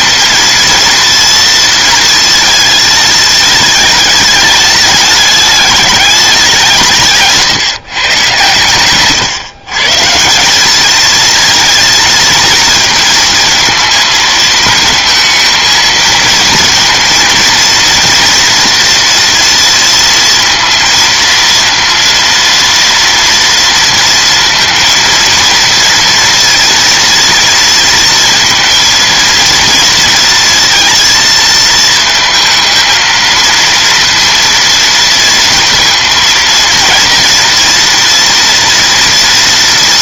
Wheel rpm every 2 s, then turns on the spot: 230, 220, 210, 180, 130, 190, 220, 220, 230, 230, 230, 230, 230, 230, 230, 230, 220, 230, 230, 230.
none